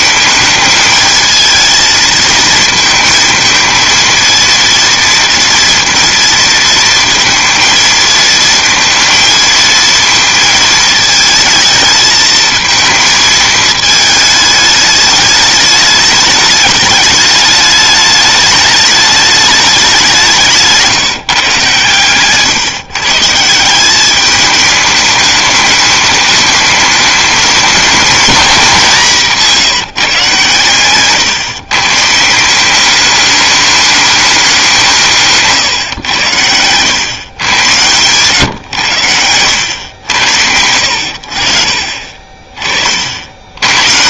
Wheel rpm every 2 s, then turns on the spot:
210, 220, 230, 230, 220, 220, 220, 210, 210, 210, 170, 140, 210, 210, 210, 120, 190, 190, 100, 120, 80, 40.
none